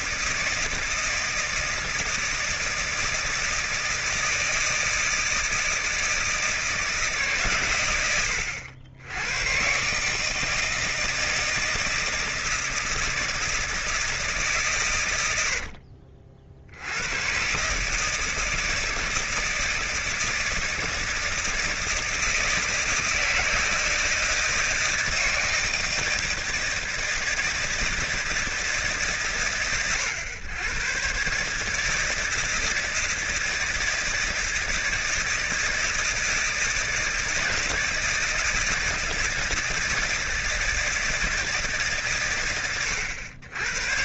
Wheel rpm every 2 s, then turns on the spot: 160, 160, 160, 160, 90, 160, 160, 130, 70, 160, 160, 170, 160, 160, 160, 120, 160, 160, 160, 160, 160, 120.
none